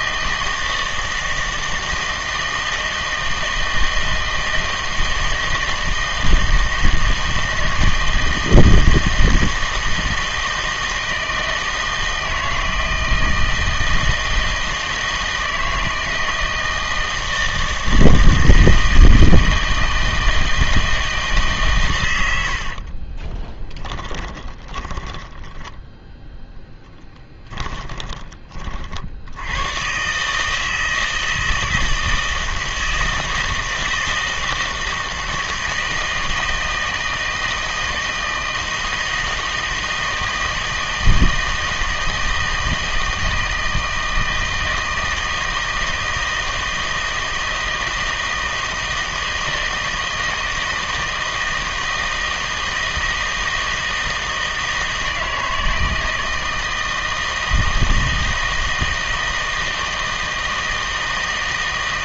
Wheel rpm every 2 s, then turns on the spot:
160, 160, 160, 160, 160, 160, 160, 160, 160, 160, 160, 60, 20, 10, 40, 160, 160, 160, 160, 160, 160, 160, 160, 160, 160, 160, 160, 160, 160, 160, 160.
22-28